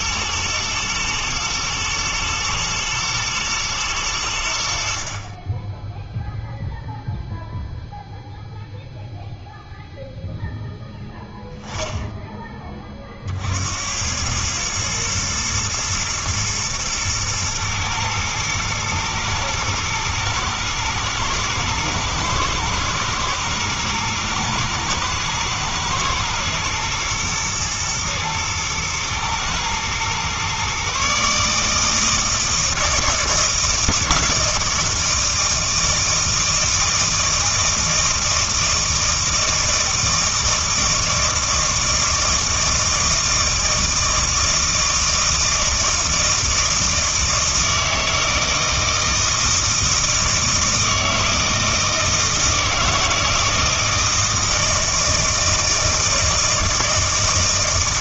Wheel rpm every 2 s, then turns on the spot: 110, 110, 70, 0, 0, 10, 20, 110, 120, 110, 110, 120, 110, 120, 110, 130, 160, 160, 160, 160, 160, 160, 160, 160, 160, 160, 160, 160, 160.
none